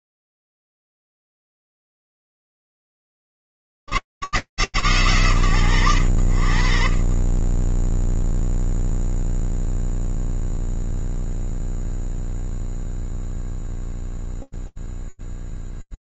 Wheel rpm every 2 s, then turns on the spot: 80, 160, 130, 50, 0, 0, 0, 0.
none